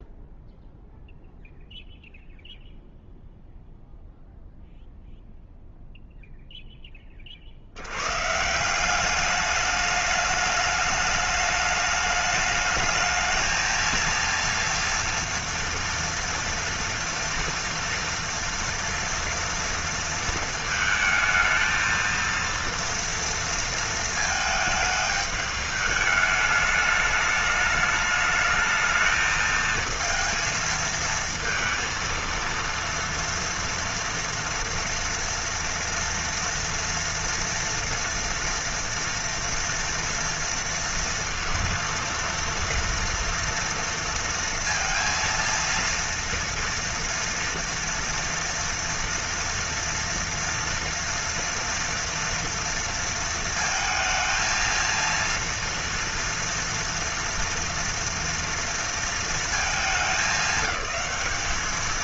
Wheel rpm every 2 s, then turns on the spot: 0, 0, 0, 0, 150, 210, 210, 230, 230, 230, 230, 230, 220, 210, 220, 220, 230, 230, 230, 230, 230, 230, 230, 230, 230, 230, 230, 220, 230, 230, 200.
none